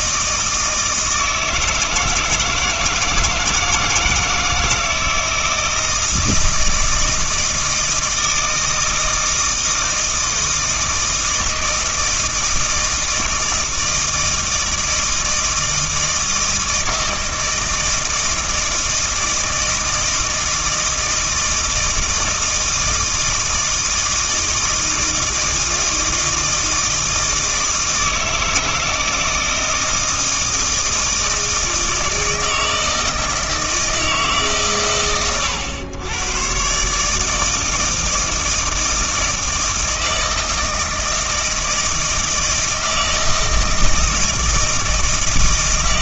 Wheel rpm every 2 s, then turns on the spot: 160, 160, 160, 160, 160, 160, 160, 160, 160, 160, 160, 160, 160, 160, 160, 160, 160, 100, 140, 160, 160, 160, 160.
none